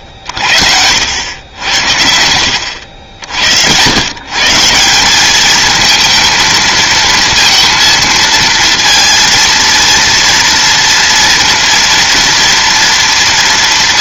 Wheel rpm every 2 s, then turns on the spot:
70, 80, 160, 230, 230, 230, 230.
none